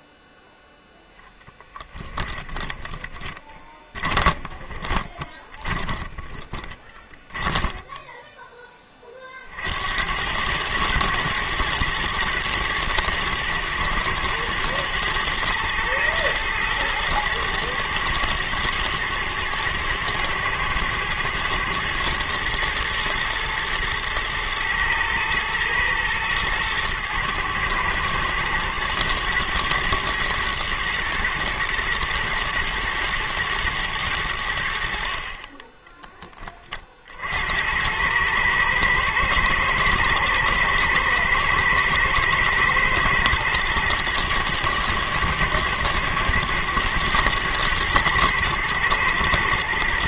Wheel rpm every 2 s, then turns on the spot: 0, 20, 20, 20, 20, 110, 120, 110, 110, 110, 110, 110, 110, 110, 110, 120, 120, 70, 30, 110, 110, 120, 110, 110, 110.
2-8